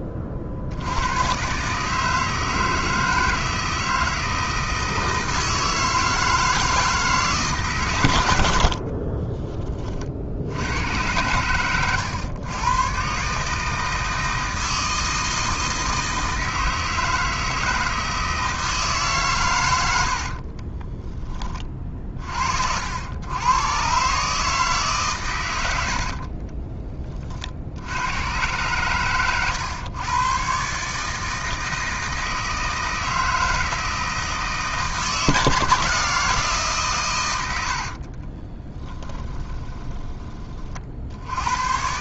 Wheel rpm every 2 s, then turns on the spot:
50, 160, 160, 160, 50, 80, 120, 160, 160, 150, 20, 70, 150, 30, 120, 140, 160, 160, 150, 30, 40.
8-10 20-22 26-28 38-40